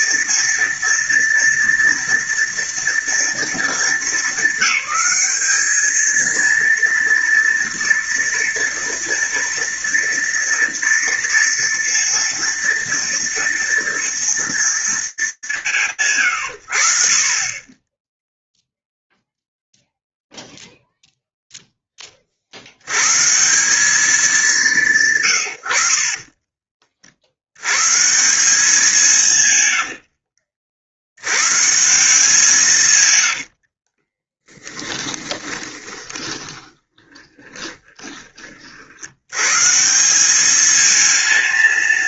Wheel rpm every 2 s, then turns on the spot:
230, 220, 210, 230, 230, 230, 230, 220, 30, 0, 0, 120, 120, 90, 150, 120, 70, 20, 10, 120, 230.
32-38